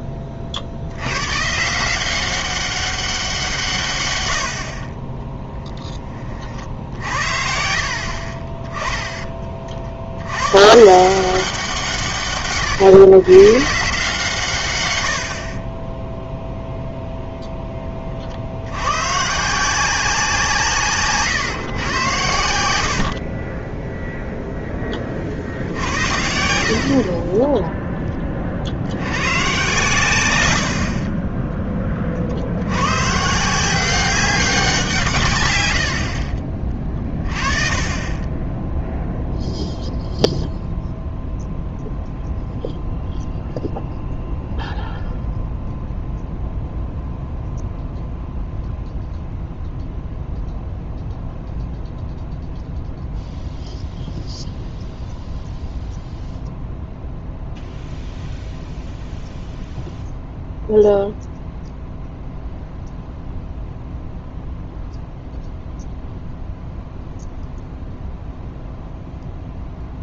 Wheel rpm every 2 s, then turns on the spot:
40, 190, 50, 50, 20, 130, 130, 120, 0, 80, 160, 80, 0, 60, 60, 60, 80, 180, 30, 0, 0, 0, 0, 0, 0, 0, 0, 0, 0, 0, 0, 0, 0, 0, 0.
none